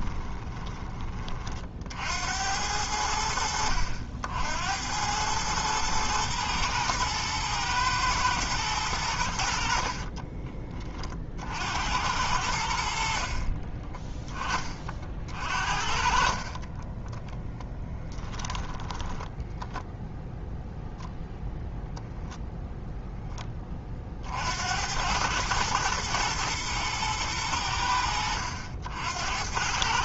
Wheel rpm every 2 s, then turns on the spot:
30, 60, 90, 110, 100, 40, 60, 30, 20, 10, 0, 0, 90, 110, 70.
16-20